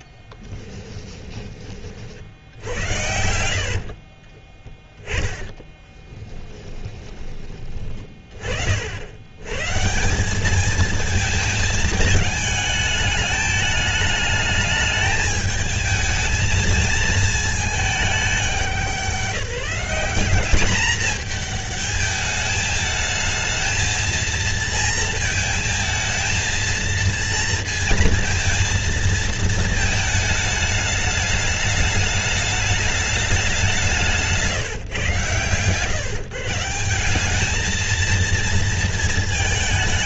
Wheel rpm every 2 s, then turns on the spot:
10, 60, 10, 20, 70, 220, 210, 220, 220, 190, 200, 210, 220, 230, 230, 210, 210, 130, 180, 230.
0-2 4-6